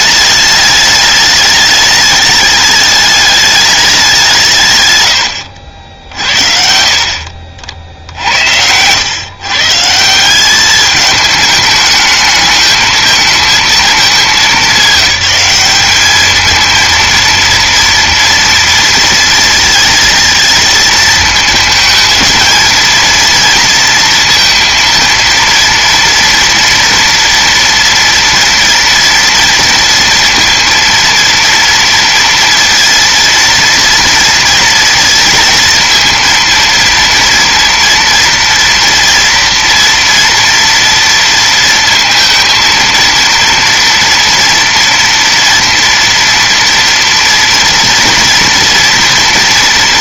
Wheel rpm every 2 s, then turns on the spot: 210, 210, 160, 50, 80, 200, 220, 210, 220, 230, 220, 230, 230, 240, 230, 230, 230, 230, 230, 230, 230, 230, 240, 230, 240.
none